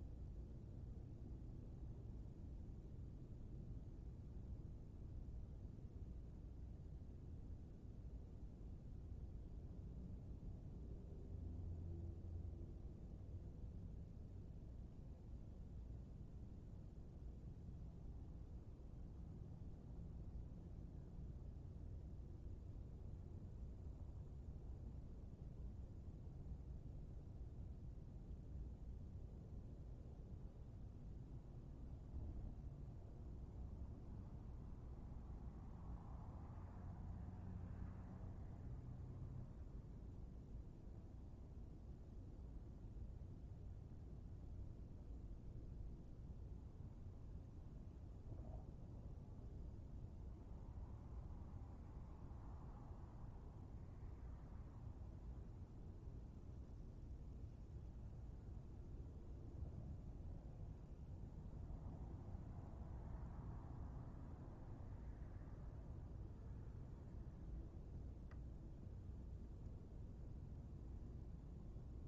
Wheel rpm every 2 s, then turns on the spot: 0, 0, 0, 0, 0, 0, 0, 0, 0, 0, 0, 0, 0, 0, 0, 0, 0, 0, 0, 0, 0, 0, 0, 0, 0, 0, 0, 0, 0, 0, 0, 0, 0, 0, 0, 0.
none